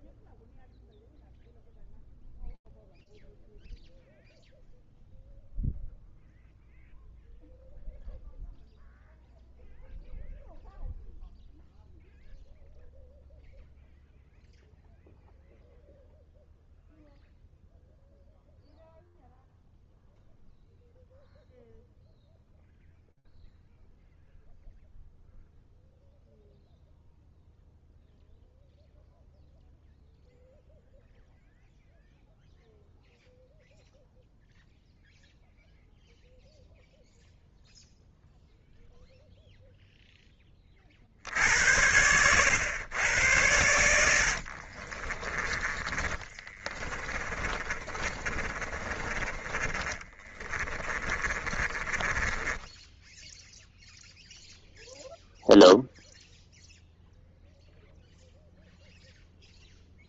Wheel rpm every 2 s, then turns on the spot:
0, 0, 0, 0, 0, 0, 0, 0, 0, 0, 0, 0, 0, 0, 0, 0, 0, 0, 0, 0, 60, 100, 30, 30, 20, 30, 10, 0, 0, 0.
44-48 50-54